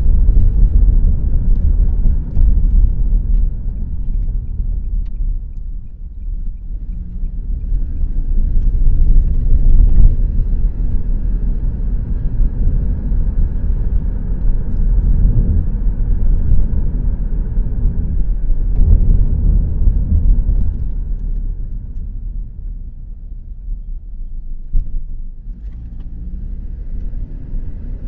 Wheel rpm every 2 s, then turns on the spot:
0, 0, 0, 0, 0, 0, 0, 0, 0, 0, 0, 0, 0, 0.
none